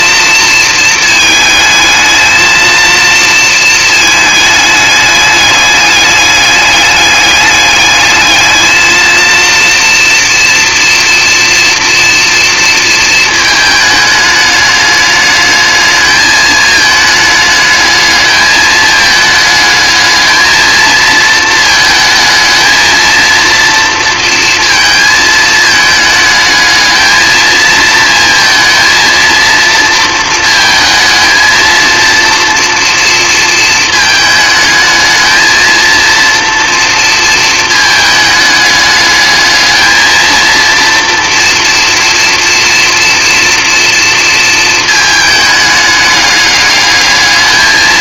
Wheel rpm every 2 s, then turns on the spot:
220, 230, 210, 200, 220, 230, 230, 210, 210, 210, 220, 220, 230, 220, 230, 220, 230, 220, 230, 210, 230, 240, 220, 210.
none